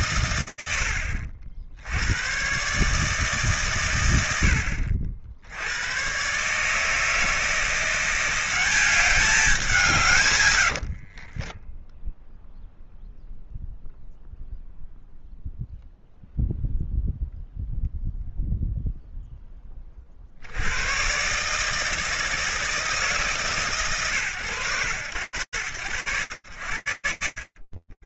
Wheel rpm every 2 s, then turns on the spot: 70, 110, 100, 170, 170, 10, 0, 0, 0, 30, 160, 140, 90, 50.
10-12